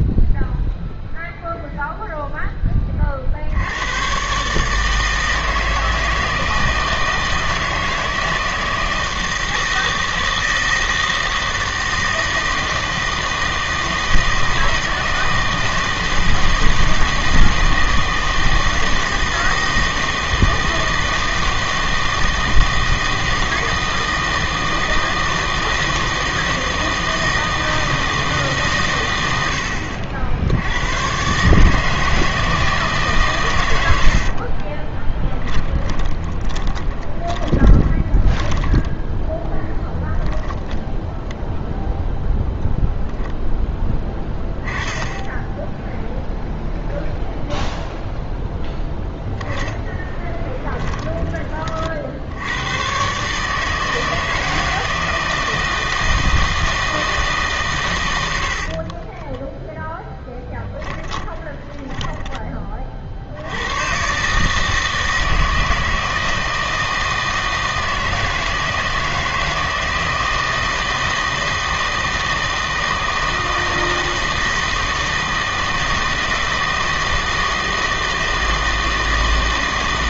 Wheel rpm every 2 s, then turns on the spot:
0, 10, 150, 160, 160, 160, 160, 160, 160, 160, 160, 160, 160, 160, 150, 90, 160, 30, 20, 10, 10, 0, 10, 0, 10, 20, 100, 160, 160, 60, 10, 30, 150, 160, 160, 160, 160, 160, 160, 160.
34-40 50-52 58-62